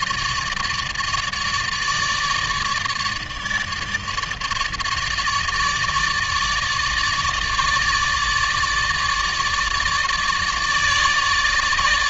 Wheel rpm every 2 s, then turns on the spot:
150, 150, 150, 150, 150, 150.
none